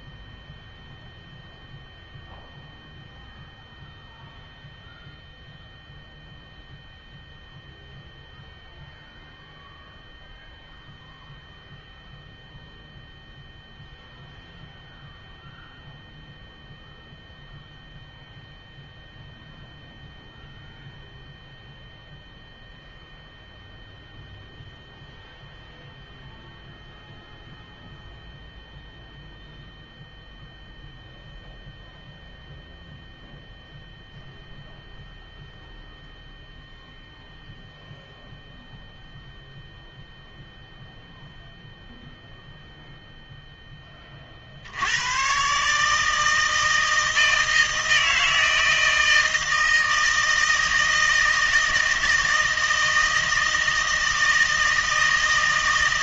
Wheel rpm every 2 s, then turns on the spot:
0, 0, 0, 0, 0, 0, 0, 0, 0, 0, 0, 0, 0, 0, 0, 0, 0, 0, 0, 0, 0, 0, 60, 160, 160, 160, 160, 160.
none